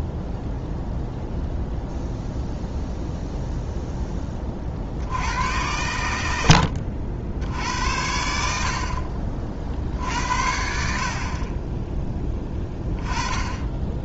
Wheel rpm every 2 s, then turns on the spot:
0, 0, 50, 70, 50, 60, 10.
none